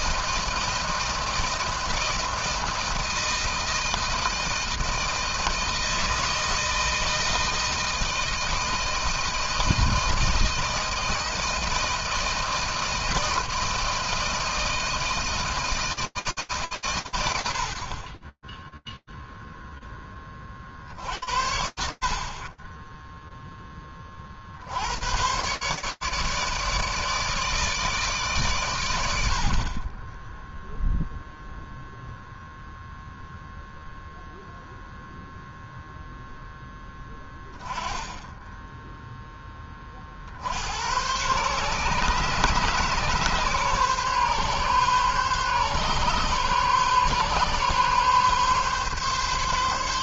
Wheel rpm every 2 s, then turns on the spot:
160, 160, 160, 160, 160, 160, 160, 160, 150, 20, 60, 20, 100, 150, 100, 0, 0, 0, 10, 10, 120, 140, 140, 140, 140.
none